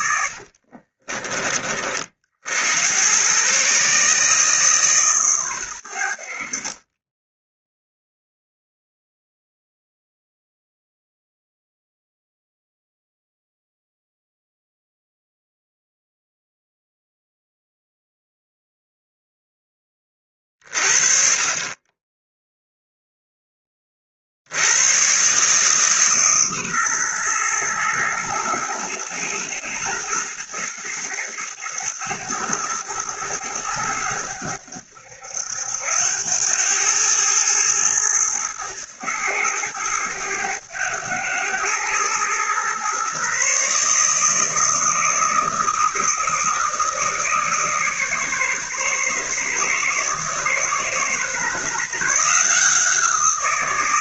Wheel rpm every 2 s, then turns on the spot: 50, 90, 150, 40, 0, 0, 0, 0, 0, 0, 50, 0, 100, 130, 110, 110, 110, 90, 100, 110, 100, 120, 160, 160, 140, 140, 170.
0-2